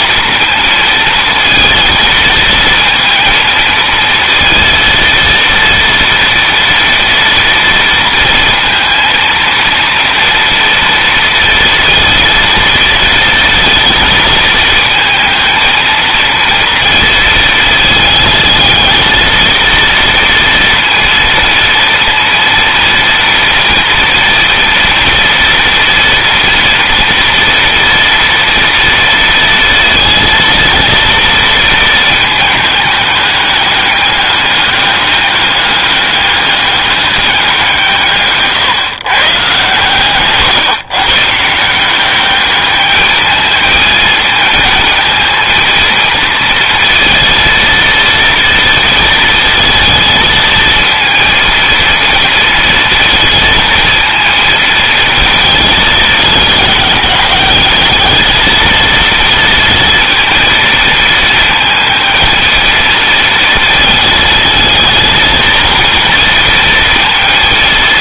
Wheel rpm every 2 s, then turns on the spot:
230, 230, 230, 230, 230, 230, 230, 220, 230, 230, 230, 230, 230, 230, 230, 230, 210, 200, 200, 140, 130, 210, 220, 230, 230, 220, 230, 230, 210, 230, 230, 220, 220, 230.
none